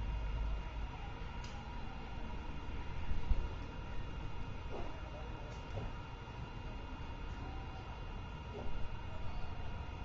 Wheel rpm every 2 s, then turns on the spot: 0, 0, 0, 0, 0.
none